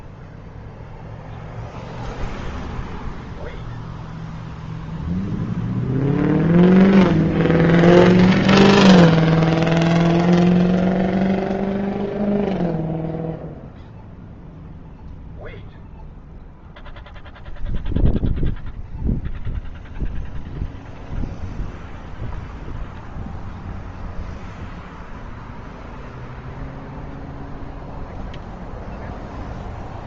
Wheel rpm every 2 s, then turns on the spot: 0, 0, 0, 0, 0, 0, 0, 0, 0, 0, 0, 0, 0, 0, 0.
none